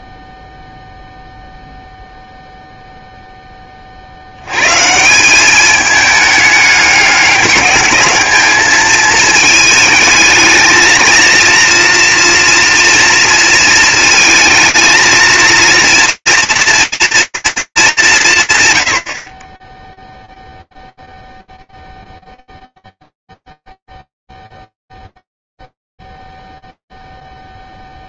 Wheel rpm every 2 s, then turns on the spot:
0, 0, 40, 210, 210, 220, 230, 220, 230, 190, 0, 0, 0, 0.
none